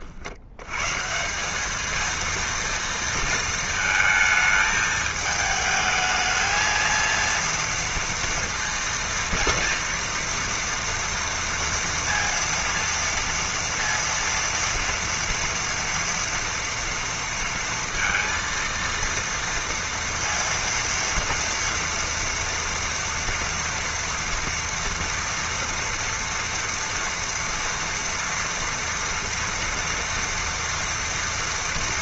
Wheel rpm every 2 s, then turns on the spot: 90, 230, 220, 220, 230, 230, 230, 230, 240, 230, 230, 230, 230, 230, 230, 230.
none